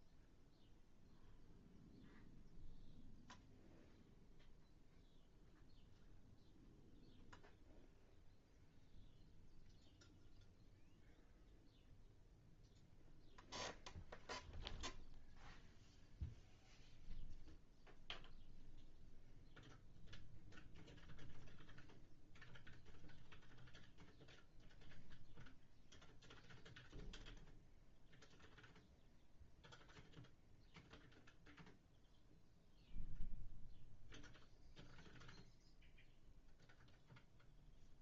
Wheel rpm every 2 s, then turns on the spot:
0, 0, 0, 0, 0, 0, 0, 0, 0, 0, 0, 0, 0, 0, 0, 0, 0, 0, 0.
none